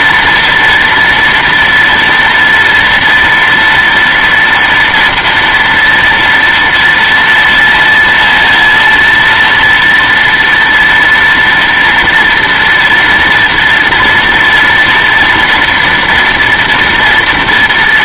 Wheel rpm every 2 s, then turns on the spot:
230, 240, 230, 230, 230, 230, 230, 240, 230.
none